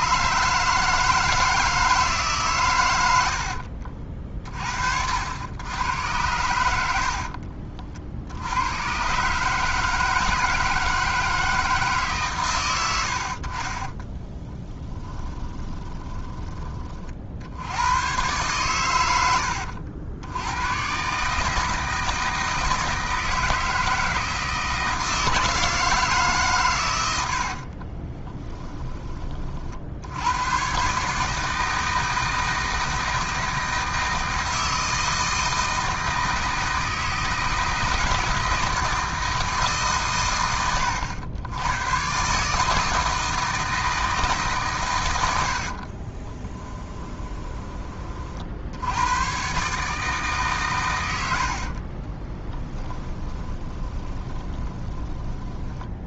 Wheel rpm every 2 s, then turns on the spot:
150, 110, 50, 90, 100, 160, 110, 20, 30, 110, 110, 160, 160, 120, 20, 130, 160, 160, 160, 160, 70, 160, 120, 10, 80, 130, 10, 20.
6-8 14-16 46-48 52-56